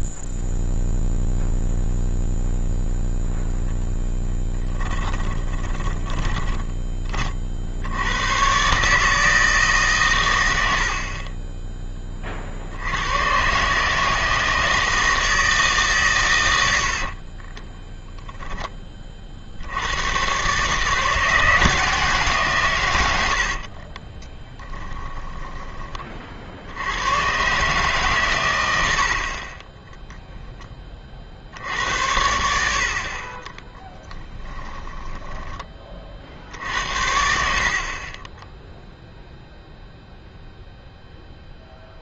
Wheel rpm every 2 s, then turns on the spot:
0, 0, 0, 20, 80, 140, 20, 160, 130, 0, 120, 150, 20, 50, 110, 20, 60, 20, 60, 10, 0.
6-8 24-26 34-36 38-40